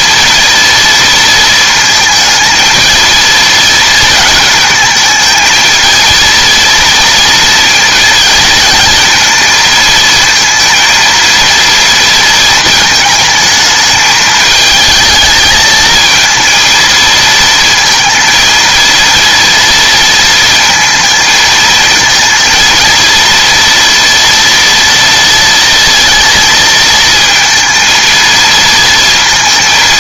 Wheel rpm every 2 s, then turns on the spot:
230, 220, 220, 230, 230, 230, 220, 220, 230, 230, 230, 230, 230, 230, 230.
none